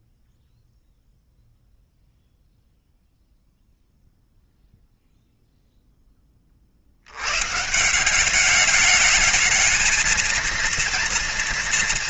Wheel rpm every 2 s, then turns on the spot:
0, 0, 0, 60, 200, 230.
none